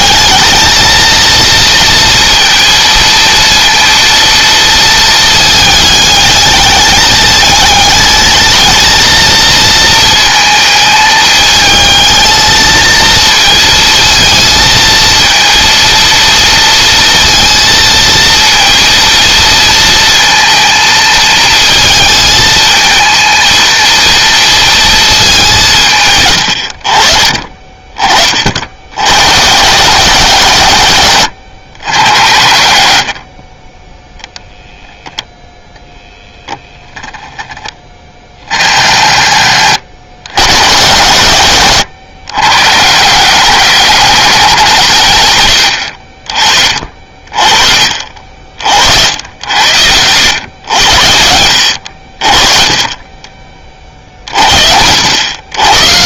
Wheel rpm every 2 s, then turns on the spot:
230, 230, 230, 210, 220, 220, 220, 230, 230, 230, 230, 220, 230, 90, 70, 120, 80, 0, 10, 50, 100, 120, 160, 50, 60, 90, 30, 60.
none